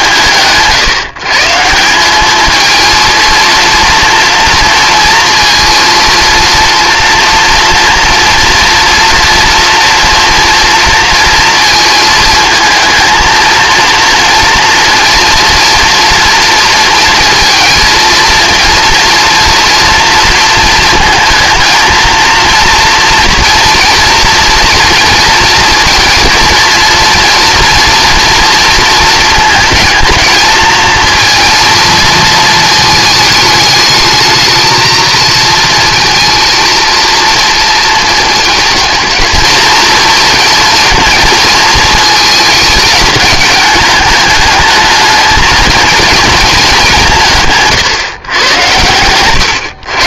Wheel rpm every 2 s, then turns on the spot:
160, 230, 230, 230, 230, 230, 220, 230, 230, 230, 230, 230, 230, 230, 230, 220, 220, 220, 230, 230, 230, 220, 220, 190, 100.
none